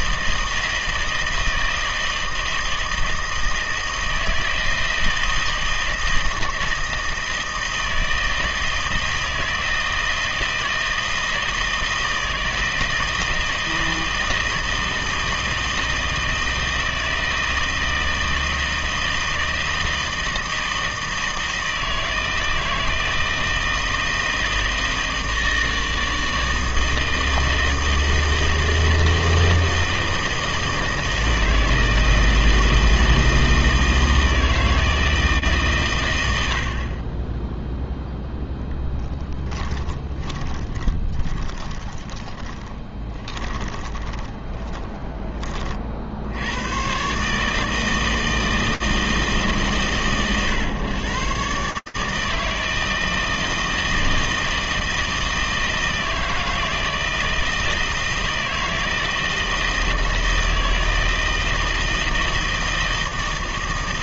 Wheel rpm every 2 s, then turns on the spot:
160, 160, 160, 160, 160, 160, 160, 160, 160, 160, 160, 160, 160, 160, 160, 160, 160, 150, 10, 10, 30, 20, 20, 140, 140, 130, 160, 160, 160, 160, 160, 160.
38-44